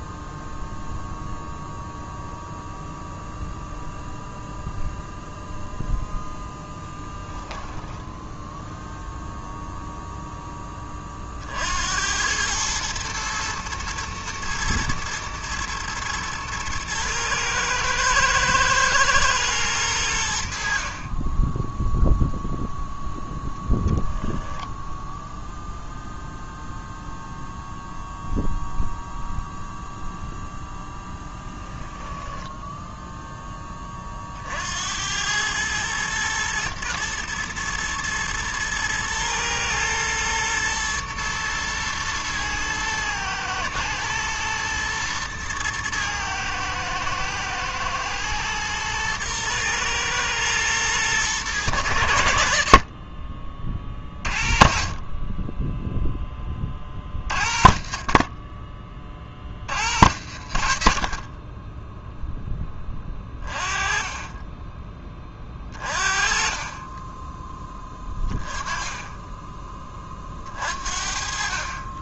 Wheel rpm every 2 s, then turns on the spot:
0, 0, 0, 0, 0, 30, 110, 110, 110, 110, 40, 0, 0, 0, 0, 0, 10, 90, 110, 110, 120, 110, 110, 110, 120, 110, 30, 30, 40, 40, 60, 20, 20, 20, 20, 50.
none